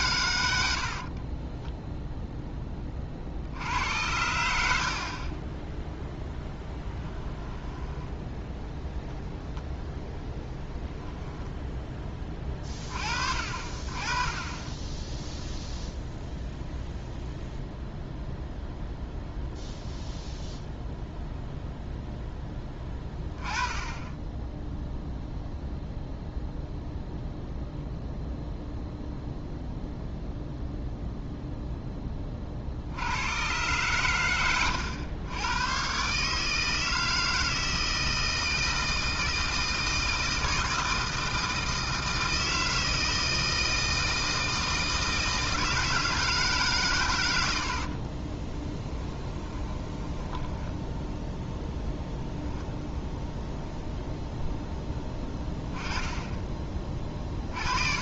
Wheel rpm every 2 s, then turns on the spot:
90, 10, 80, 10, 0, 0, 20, 20, 0, 0, 0, 10, 10, 0, 0, 0, 40, 90, 160, 160, 160, 160, 160, 140, 30, 10, 0, 0, 20.
48-52